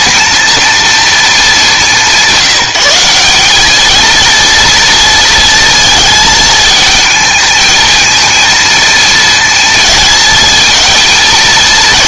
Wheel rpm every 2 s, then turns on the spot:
230, 170, 230, 220, 230, 220.
none